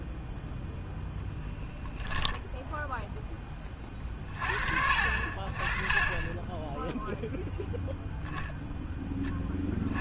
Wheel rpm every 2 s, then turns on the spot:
0, 0, 50, 10, 0.
none